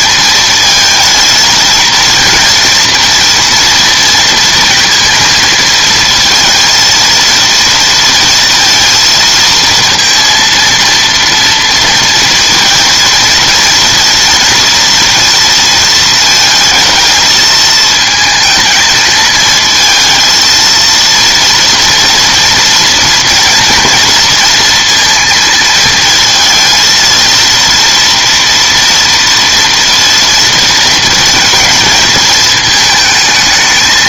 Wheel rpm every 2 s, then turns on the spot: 220, 230, 230, 230, 230, 230, 230, 230, 230, 220, 230, 230, 230, 220, 230, 230, 220.
none